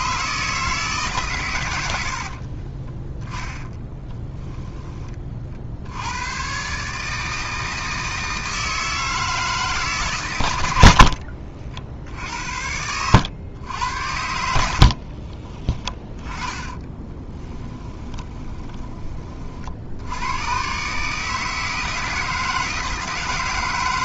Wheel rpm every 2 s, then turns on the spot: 150, 30, 20, 130, 160, 80, 80, 70, 20, 20, 130, 160.
2-4 14-18